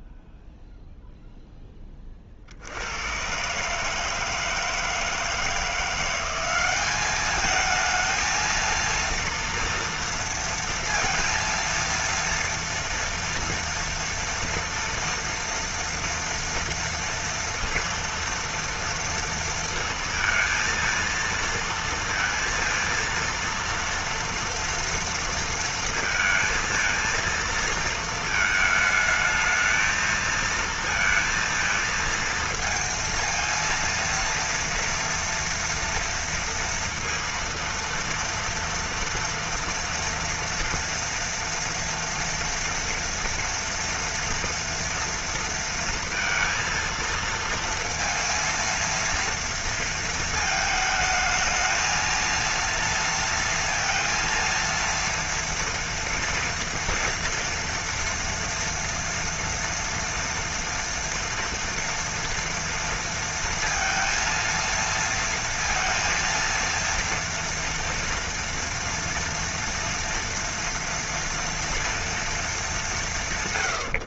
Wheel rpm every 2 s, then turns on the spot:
0, 60, 160, 190, 230, 230, 230, 230, 230, 230, 230, 230, 230, 230, 220, 230, 230, 230, 230, 230, 230, 230, 240, 230, 230, 220, 230, 230, 230, 230, 230, 230, 230, 230, 230, 230, 190.
none